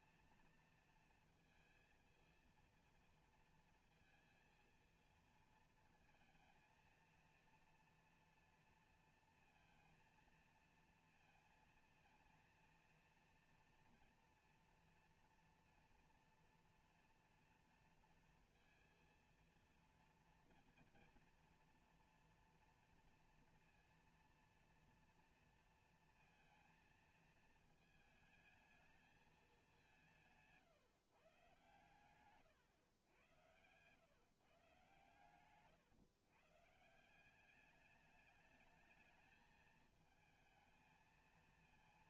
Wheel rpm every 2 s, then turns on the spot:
230, 230, 230, 230, 230, 230, 230, 240, 240, 230, 230, 230, 230, 220, 220, 140, 120, 140, 140, 220, 220.
none